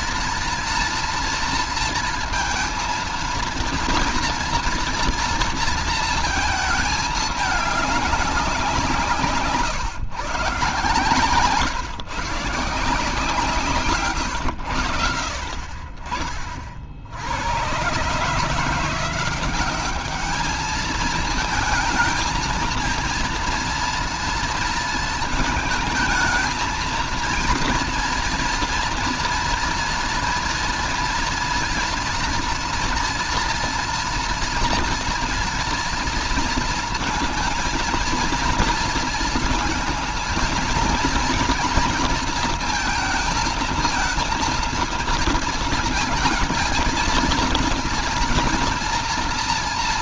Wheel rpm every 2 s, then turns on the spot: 230, 230, 230, 220, 180, 140, 150, 100, 50, 160, 210, 220, 230, 230, 230, 240, 230, 230, 230, 230, 220, 220, 220, 230, 230.
none